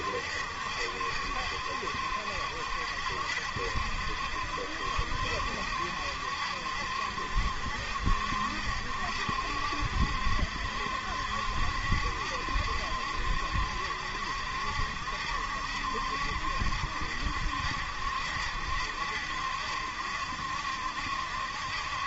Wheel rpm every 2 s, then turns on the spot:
70, 70, 70, 70, 70, 70, 70, 70, 70, 70, 70.
none